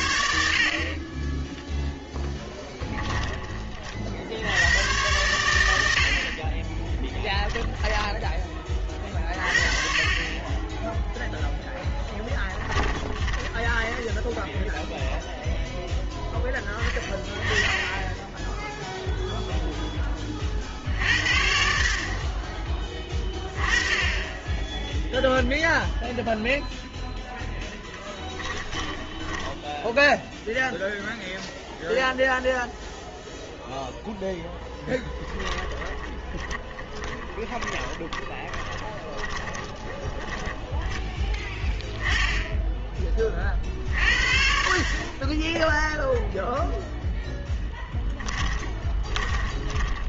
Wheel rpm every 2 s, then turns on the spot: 50, 10, 100, 20, 20, 10, 10, 0, 10, 0, 50, 20, 0, 0, 20, 0, 0, 10, 20, 20, 10, 10, 40, 0, 20.
2-4 6-8 12-14 28-30 34-40 48-50